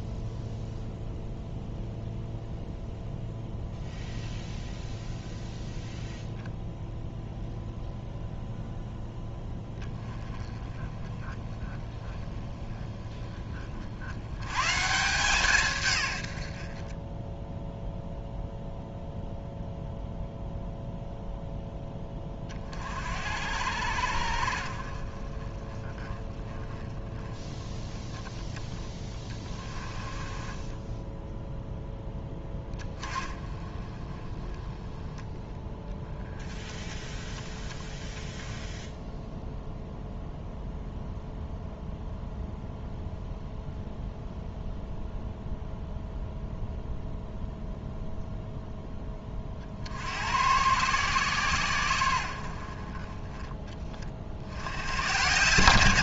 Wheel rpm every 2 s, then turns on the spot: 0, 0, 0, 0, 0, 20, 20, 140, 40, 0, 0, 40, 40, 10, 30, 10, 20, 10, 20, 0, 0, 0, 0, 0, 10, 110, 40, 100.
28-32